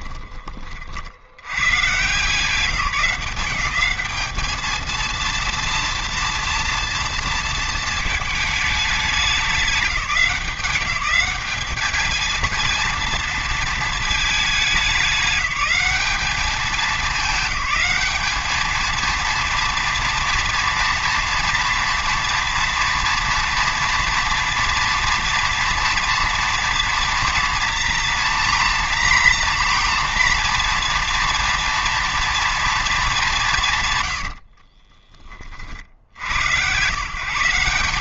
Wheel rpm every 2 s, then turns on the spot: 50, 180, 220, 230, 210, 200, 230, 210, 210, 220, 230, 230, 230, 230, 230, 230, 220, 30, 120.
34-36